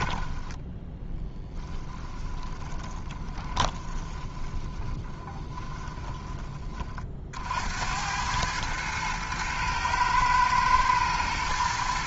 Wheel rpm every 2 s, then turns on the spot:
10, 20, 20, 40, 110, 110.
0-6